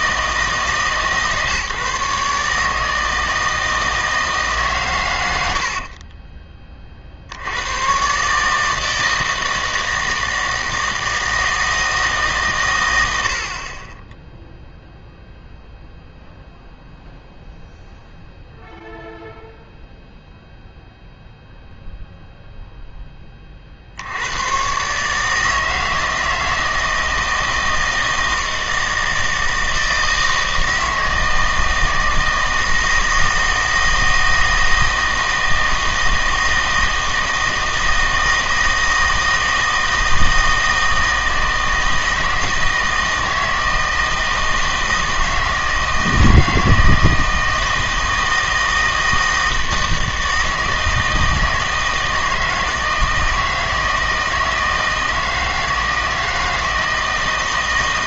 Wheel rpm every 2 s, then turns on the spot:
150, 150, 130, 30, 160, 160, 110, 0, 0, 0, 0, 0, 120, 160, 160, 160, 160, 160, 160, 160, 160, 160, 160, 160, 160, 160, 160, 160, 160.
none